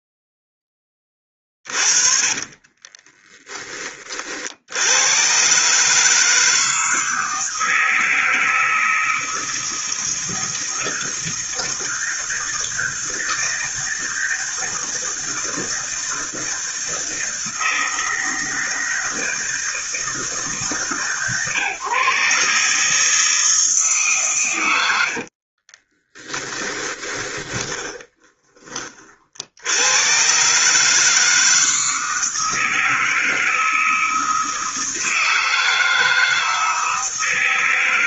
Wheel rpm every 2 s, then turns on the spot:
10, 30, 80, 160, 160, 160, 160, 160, 160, 160, 150, 150, 100, 20, 30, 150, 160, 160, 160.
2-4 26-28